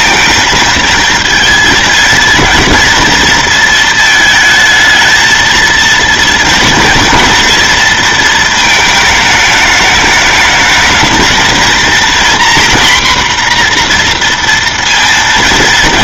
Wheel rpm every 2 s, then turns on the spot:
220, 230, 220, 230, 220, 210, 250, 230.
none